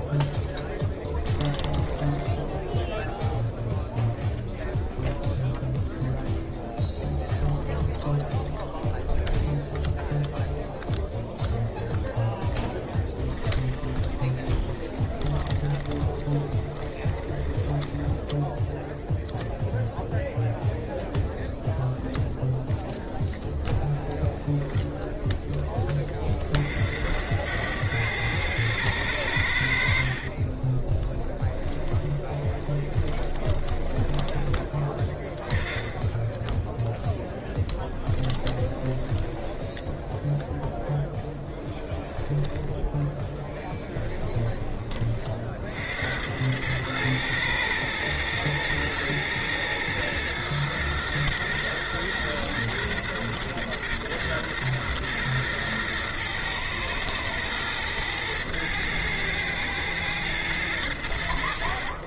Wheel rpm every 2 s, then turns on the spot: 10, 0, 0, 0, 0, 0, 0, 20, 20, 10, 0, 0, 0, 40, 100, 30, 20, 20, 10, 10, 0, 10, 20, 100, 110, 120, 120, 120, 110, 110, 110.
0-2 14-18 30-34 38-40